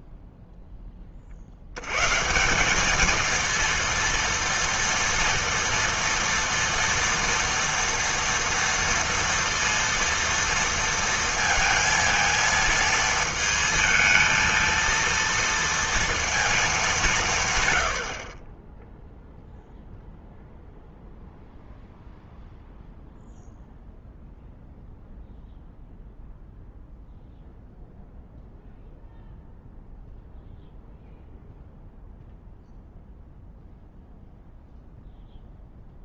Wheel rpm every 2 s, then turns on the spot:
0, 180, 230, 230, 230, 230, 230, 230, 220, 20, 0, 0, 0, 0, 0, 0, 0, 0.
none